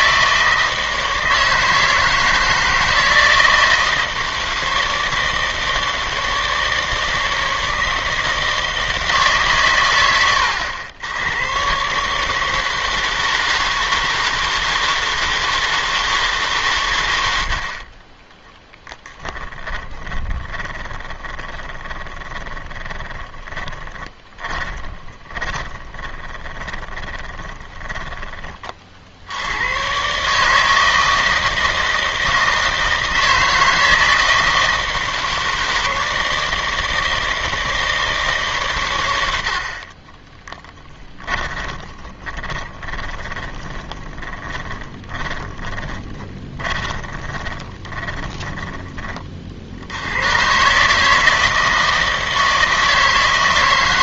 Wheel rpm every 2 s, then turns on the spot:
160, 160, 160, 160, 160, 80, 160, 160, 120, 10, 20, 20, 20, 20, 40, 160, 160, 160, 160, 120, 10, 20, 20, 20, 20, 150, 160.
18-28 40-48